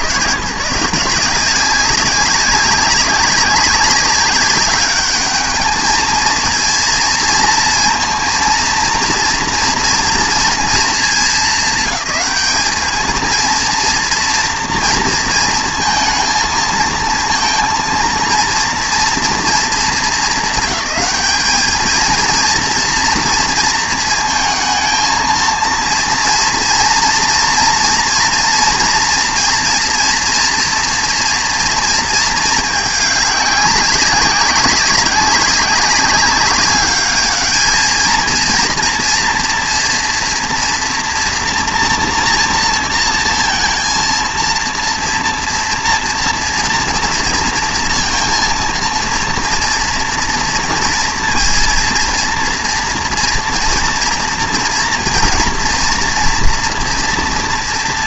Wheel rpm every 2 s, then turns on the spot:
140, 190, 200, 230, 230, 230, 200, 230, 220, 230, 210, 230, 230, 230, 230, 230, 210, 200, 200, 230, 230, 230, 230, 230, 230, 230, 240, 230, 230.
none